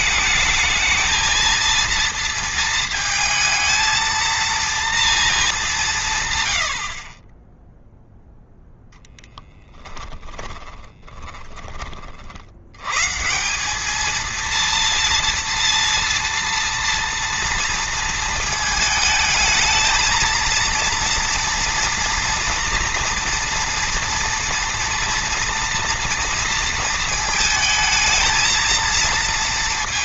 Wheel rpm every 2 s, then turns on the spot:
220, 220, 230, 60, 10, 20, 130, 230, 230, 220, 230, 230, 230, 230, 230.
10-12